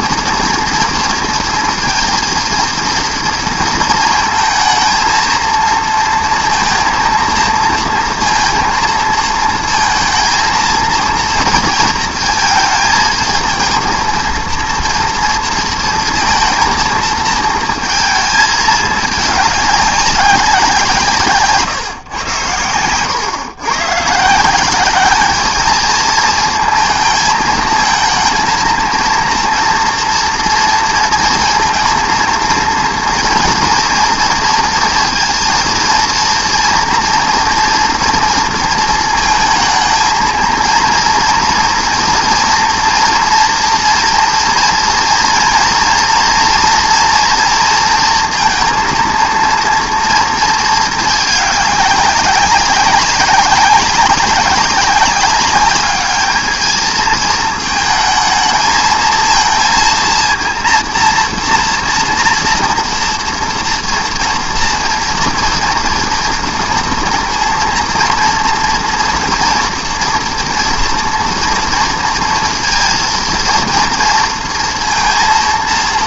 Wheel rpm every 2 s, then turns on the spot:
230, 230, 230, 230, 230, 230, 220, 230, 230, 220, 180, 110, 190, 220, 230, 230, 230, 230, 230, 230, 230, 240, 230, 230, 230, 220, 190, 200, 220, 220, 230, 230, 240, 230, 230, 230, 230, 230.
22-24